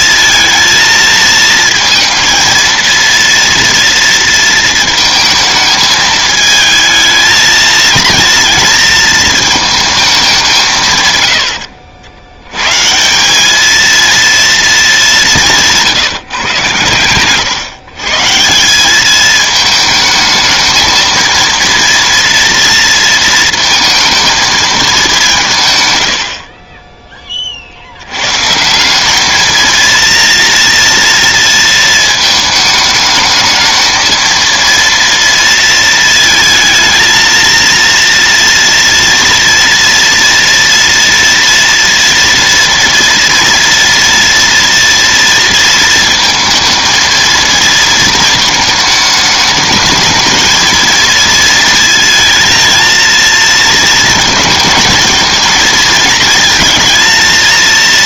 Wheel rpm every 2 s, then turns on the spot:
230, 230, 230, 220, 230, 170, 110, 230, 130, 160, 220, 230, 220, 50, 150, 230, 220, 230, 220, 230, 230, 230, 230, 230, 220, 220, 220, 220, 220.
none